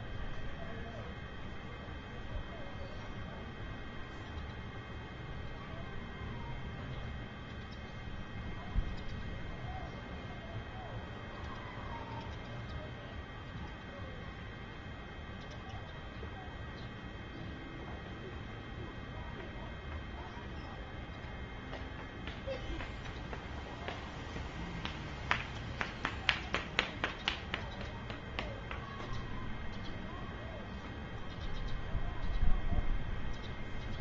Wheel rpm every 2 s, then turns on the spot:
0, 0, 0, 0, 0, 0, 0, 0, 0, 0, 0, 0, 0, 0, 0, 0, 0.
none